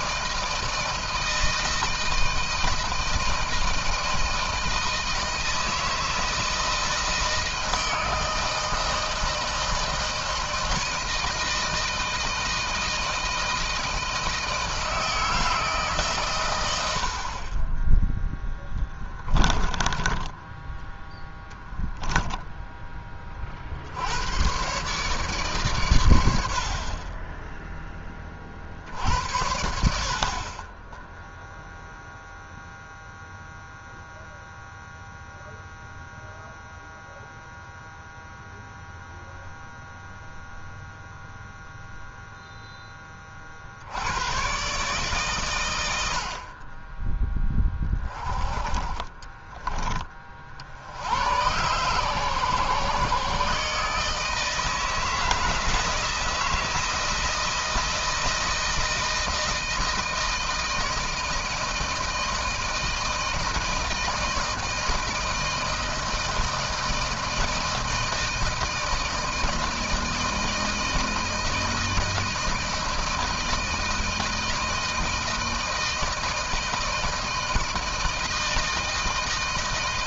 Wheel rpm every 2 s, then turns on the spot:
160, 160, 160, 160, 160, 160, 160, 160, 90, 10, 10, 10, 130, 50, 50, 20, 0, 0, 0, 0, 0, 10, 120, 30, 30, 70, 130, 160, 160, 160, 160, 160, 160, 160, 160, 160, 160, 160, 160, 160.
18-20